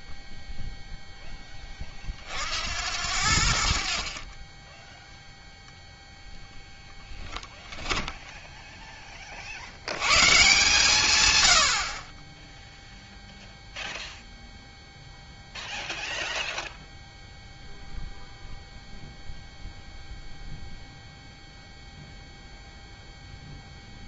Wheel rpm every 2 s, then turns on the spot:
0, 70, 10, 10, 10, 140, 0, 0, 0, 0, 0, 0.
none